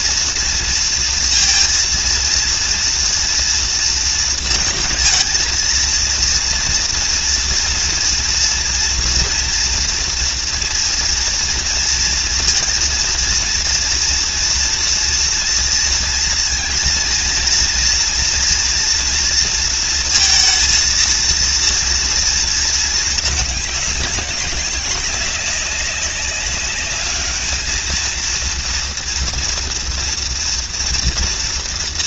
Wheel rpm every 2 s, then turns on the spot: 230, 230, 230, 240, 230, 230, 230, 230, 230, 230, 230, 230, 190, 200, 230, 230.
none